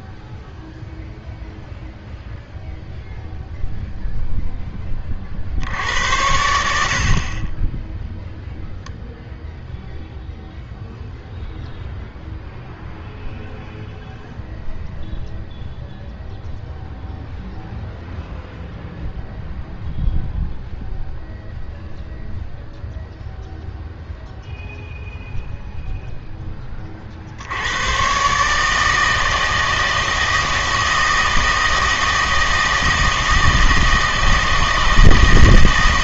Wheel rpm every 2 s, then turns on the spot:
0, 0, 10, 80, 0, 0, 0, 0, 0, 0, 0, 0, 0, 20, 150, 160, 160, 160.
none